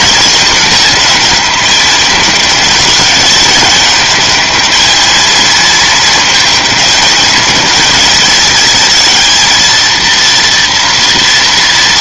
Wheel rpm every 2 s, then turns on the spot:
210, 210, 210, 220, 220, 230.
none